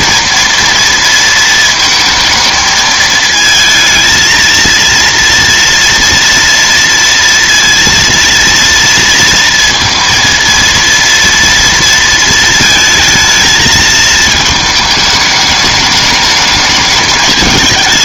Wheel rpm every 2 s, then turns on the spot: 230, 220, 230, 230, 230, 230, 220, 220, 210.
none